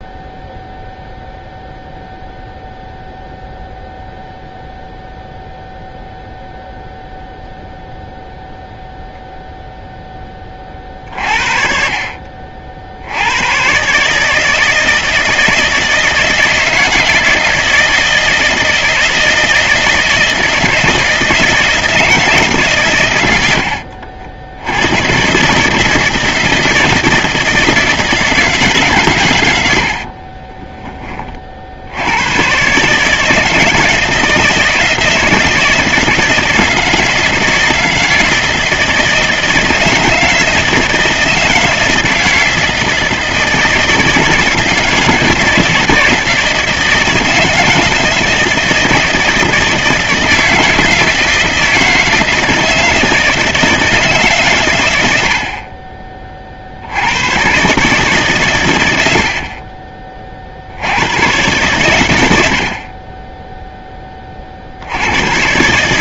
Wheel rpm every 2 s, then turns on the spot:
0, 0, 0, 0, 0, 40, 70, 160, 160, 160, 160, 120, 100, 160, 140, 30, 140, 160, 160, 160, 160, 160, 160, 160, 160, 160, 160, 100, 80, 90, 90, 30, 80.
none